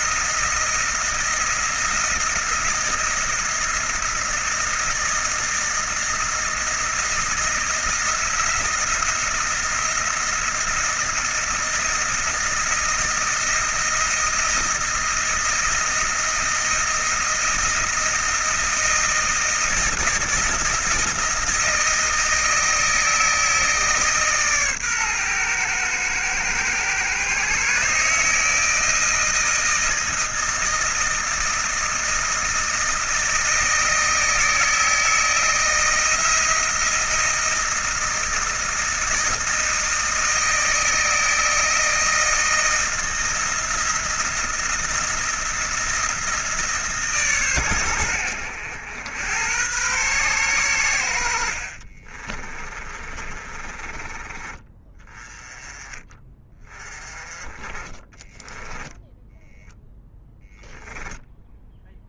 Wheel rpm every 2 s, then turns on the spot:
160, 170, 160, 160, 170, 170, 170, 160, 160, 160, 160, 160, 130, 120, 160, 160, 160, 160, 170, 160, 160, 160, 170, 150, 90, 90, 30, 20, 20, 10, 0.
52-54